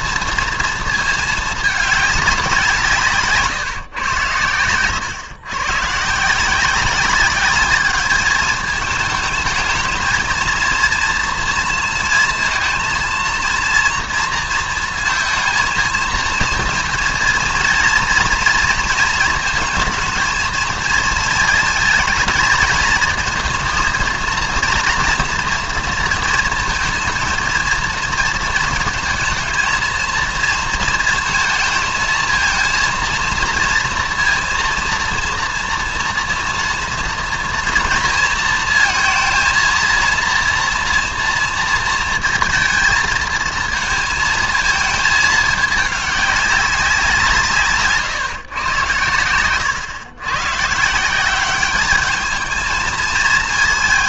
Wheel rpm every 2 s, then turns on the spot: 230, 170, 110, 180, 210, 230, 230, 230, 220, 230, 220, 220, 230, 230, 230, 220, 230, 230, 230, 230, 230, 220, 220, 190, 120, 140, 220.
none